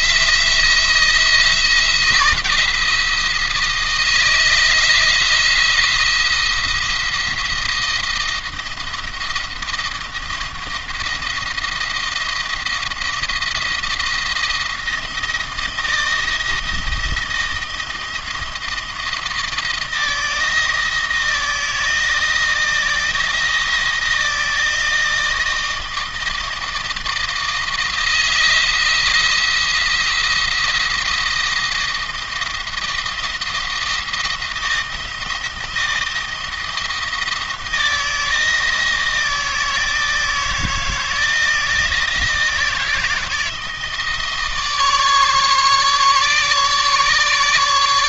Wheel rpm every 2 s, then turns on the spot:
170, 170, 160, 170, 160, 170, 170, 170, 170, 170, 160, 170, 160, 160, 170, 170, 170, 170, 160, 160, 160, 160, 150, 140.
none